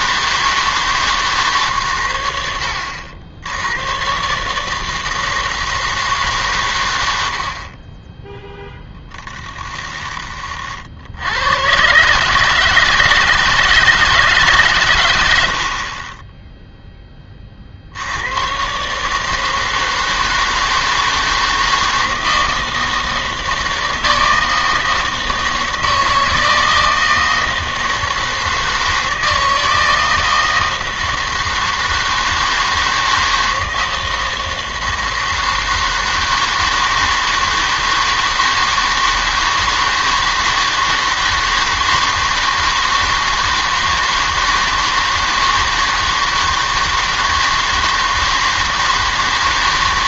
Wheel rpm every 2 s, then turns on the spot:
160, 80, 150, 140, 0, 50, 160, 140, 10, 130, 160, 160, 160, 160, 160, 160, 160, 160, 160, 160, 160, 160, 160, 160, 160.
none